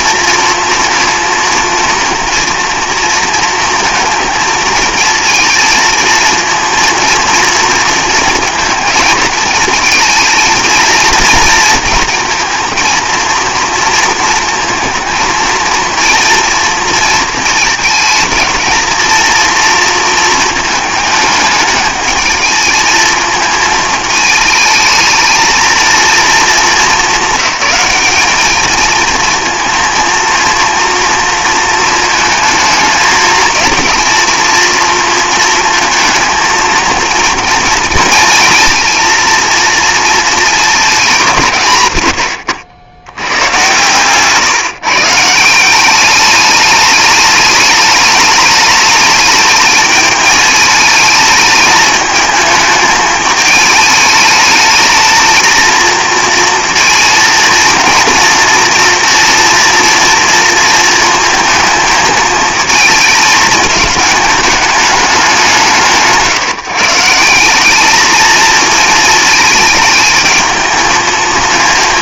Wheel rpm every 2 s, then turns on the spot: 230, 240, 230, 230, 220, 230, 230, 230, 230, 230, 220, 220, 220, 210, 220, 230, 220, 230, 230, 230, 210, 80, 150, 210, 210, 220, 220, 220, 230, 230, 230, 220, 210, 150, 220, 220.
none